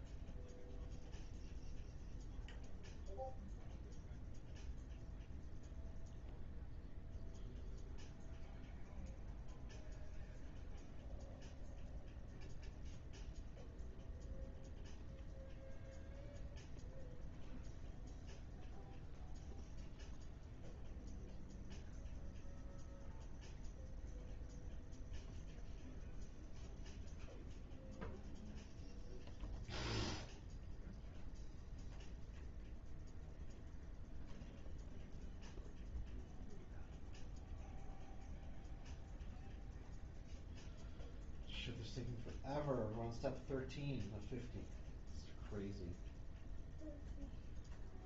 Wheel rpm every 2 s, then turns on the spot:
0, 0, 0, 0, 0, 0, 0, 0, 0, 0, 0, 0, 0, 0, 0, 0, 0, 0, 0, 0, 0, 0, 0, 0.
none